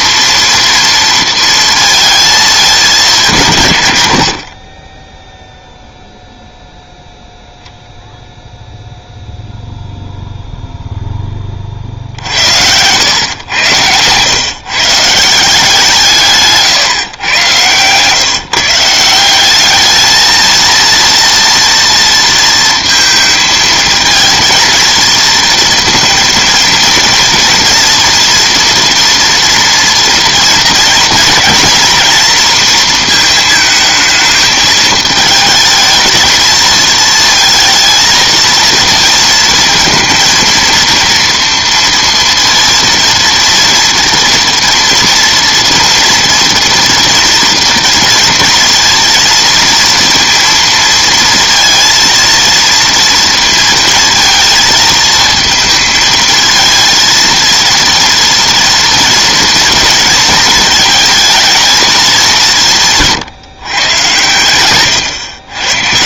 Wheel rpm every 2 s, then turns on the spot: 230, 210, 40, 10, 10, 0, 80, 140, 150, 150, 230, 230, 220, 230, 240, 230, 230, 220, 220, 230, 230, 230, 230, 230, 230, 230, 230, 230, 230, 230, 220, 160, 110.
64-66